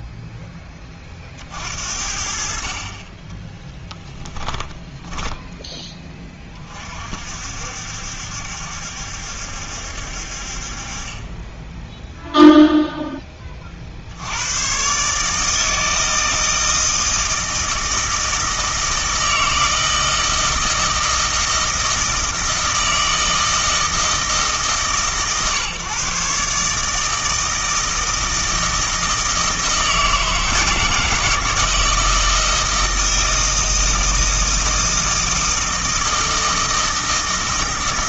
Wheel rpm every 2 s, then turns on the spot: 10, 40, 10, 30, 70, 40, 0, 110, 160, 160, 160, 160, 150, 150, 160, 160, 160, 160, 160.
4-6